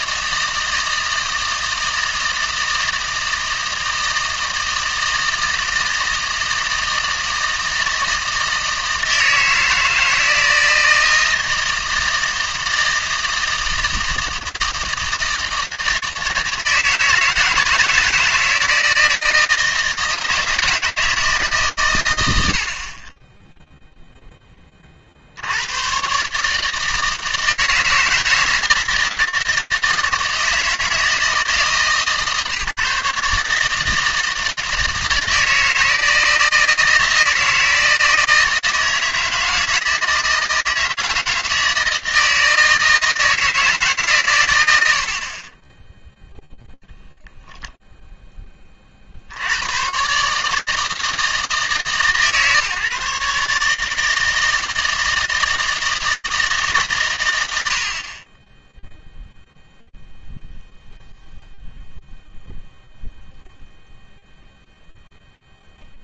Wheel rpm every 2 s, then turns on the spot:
160, 160, 160, 160, 160, 160, 160, 160, 160, 160, 160, 70, 40, 160, 160, 160, 150, 160, 160, 160, 160, 160, 80, 0, 30, 160, 150, 160, 130, 0, 0, 0, 0.
none